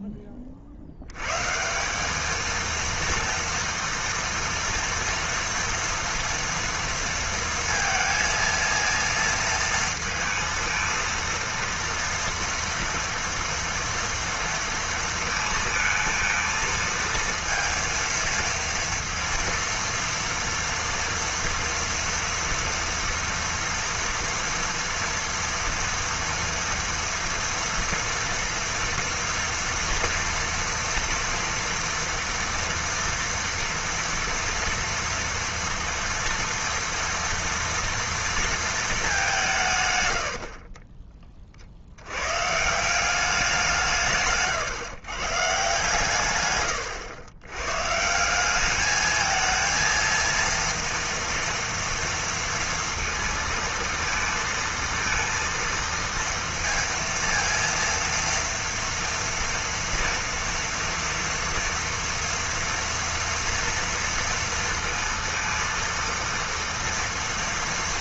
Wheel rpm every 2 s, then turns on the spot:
60, 230, 230, 230, 230, 230, 230, 230, 230, 230, 230, 230, 230, 230, 230, 240, 240, 230, 230, 230, 50, 160, 140, 100, 200, 230, 230, 230, 230, 240, 230, 230, 230, 230.
40-42